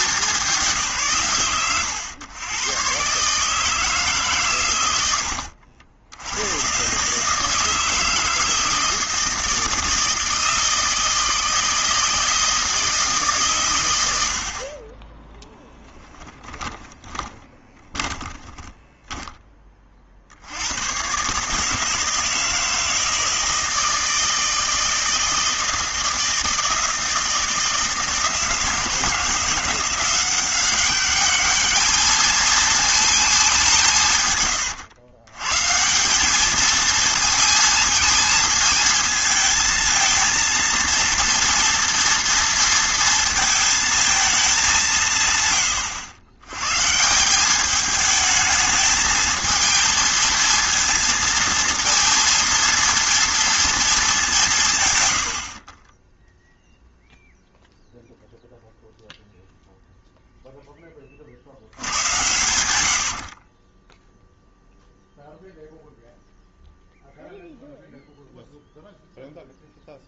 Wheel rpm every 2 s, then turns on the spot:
190, 130, 120, 110, 160, 160, 160, 50, 10, 10, 90, 160, 160, 160, 160, 190, 220, 110, 220, 220, 230, 230, 200, 110, 220, 230, 230, 170, 0, 0, 10, 100, 0, 0, 0.
16-20